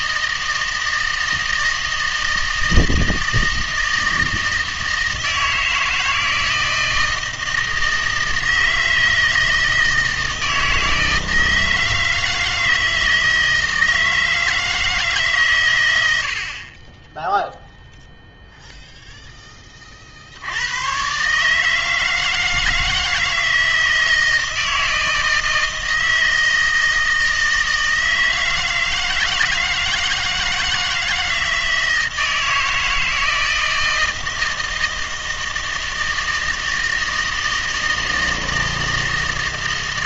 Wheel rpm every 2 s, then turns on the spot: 160, 160, 160, 160, 160, 160, 160, 160, 40, 0, 80, 160, 160, 160, 160, 160, 160, 160, 160, 160.
none